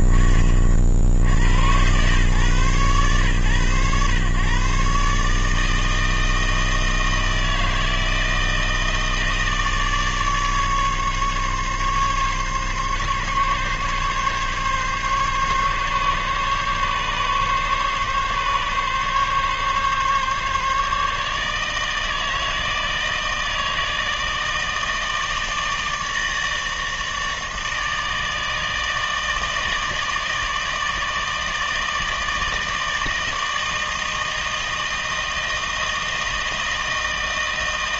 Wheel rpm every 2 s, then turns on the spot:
30, 120, 120, 160, 160, 150, 140, 140, 140, 140, 140, 160, 160, 160, 160, 160, 160, 160, 160.
none